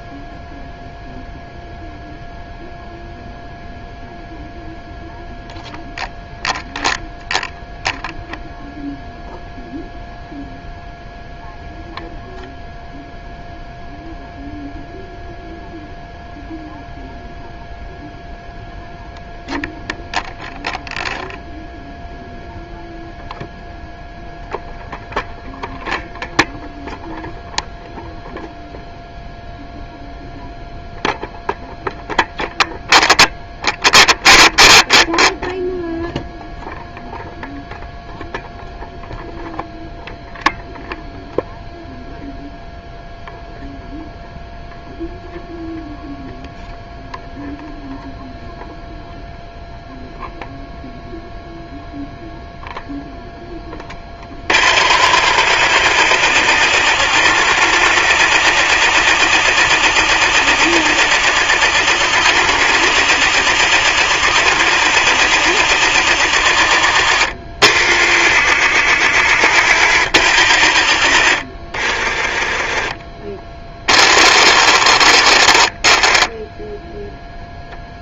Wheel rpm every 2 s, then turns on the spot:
0, 0, 0, 0, 0, 0, 0, 0, 0, 0, 0, 0, 0, 0, 0, 0, 0, 0, 0, 0, 0, 0, 0, 0, 0, 0, 0, 30, 40, 40, 40, 40, 40, 30, 50, 30, 20, 50, 10.
74-78